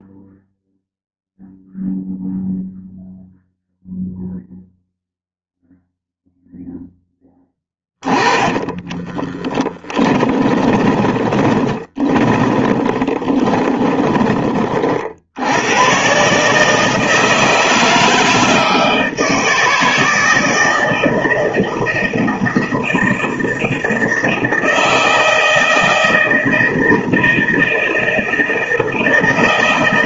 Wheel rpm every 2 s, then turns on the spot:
0, 0, 0, 0, 20, 20, 10, 30, 150, 160, 160, 160, 160, 170, 160.
8-14